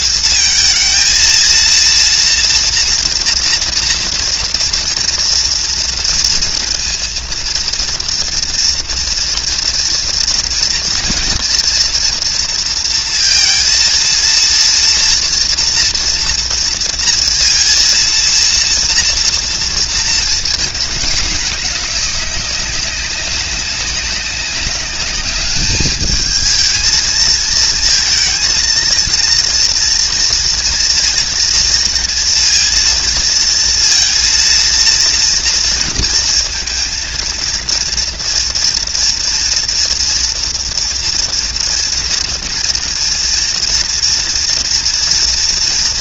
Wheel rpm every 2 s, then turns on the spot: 220, 230, 230, 230, 230, 230, 230, 230, 230, 230, 220, 200, 200, 220, 230, 230, 230, 230, 230, 230, 240, 230, 230.
none